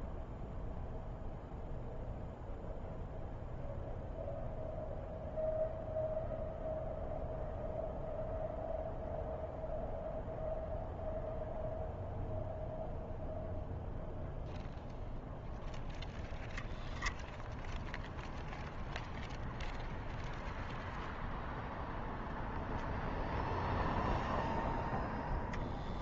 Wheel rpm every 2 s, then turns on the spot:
0, 0, 0, 0, 0, 0, 0, 0, 0, 0, 0, 0, 10.
none